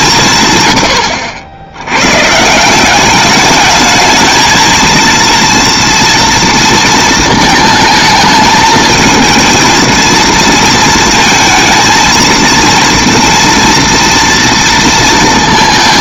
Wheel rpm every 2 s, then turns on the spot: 90, 190, 230, 230, 220, 230, 230, 230.
none